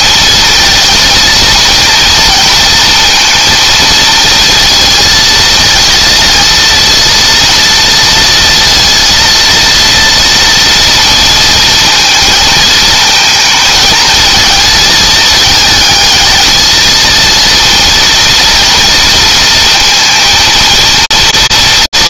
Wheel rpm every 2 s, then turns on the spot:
230, 230, 230, 230, 230, 230, 220, 220, 220, 230, 230.
none